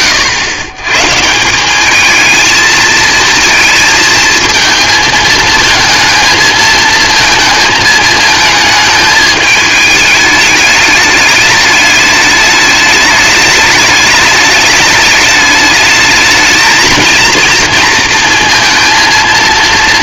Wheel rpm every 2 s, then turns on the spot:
120, 220, 230, 220, 220, 210, 210, 210, 220, 230.
none